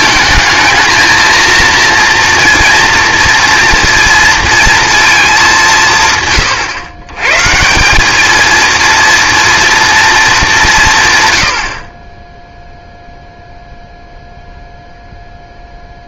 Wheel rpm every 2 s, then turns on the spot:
230, 230, 230, 120, 230, 190, 0, 0.
none